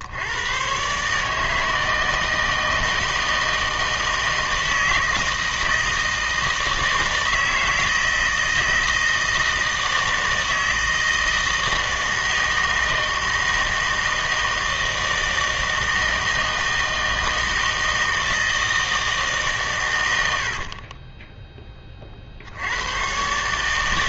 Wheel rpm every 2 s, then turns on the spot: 130, 160, 160, 160, 160, 160, 160, 160, 160, 160, 40, 90.
20-22